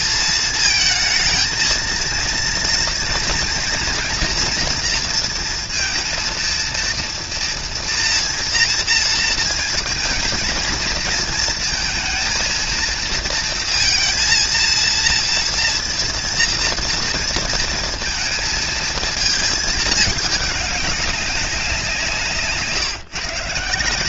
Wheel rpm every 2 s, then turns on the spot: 220, 230, 230, 230, 230, 230, 230, 230, 230, 220, 200, 150.
none